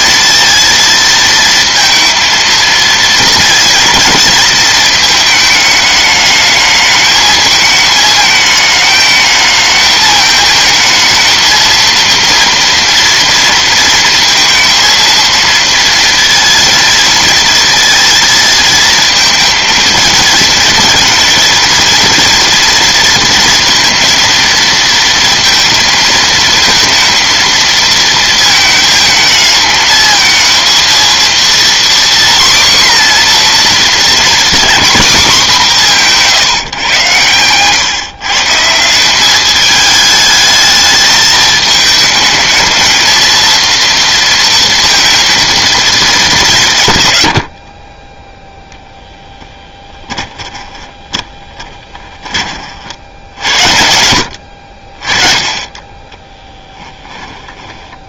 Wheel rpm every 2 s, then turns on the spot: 230, 230, 220, 220, 220, 220, 230, 230, 230, 230, 230, 230, 230, 230, 220, 230, 260, 230, 140, 160, 220, 220, 230, 140, 0, 10, 50, 60, 10.
50-52 56-58